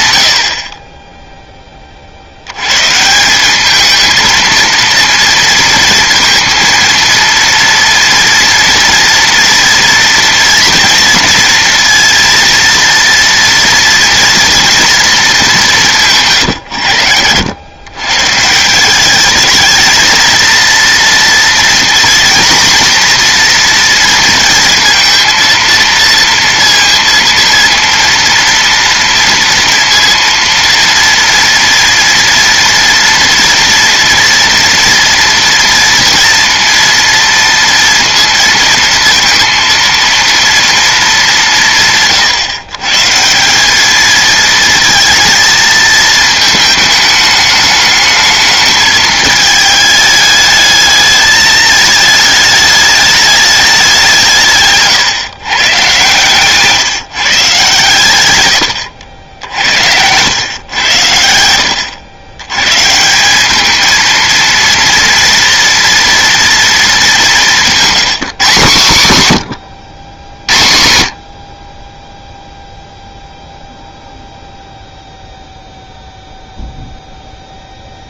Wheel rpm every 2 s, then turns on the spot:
60, 120, 230, 230, 230, 230, 230, 230, 100, 180, 230, 240, 230, 230, 230, 230, 230, 230, 230, 230, 230, 130, 230, 220, 220, 210, 210, 140, 150, 90, 100, 130, 230, 220, 150, 60, 0, 0, 0.
none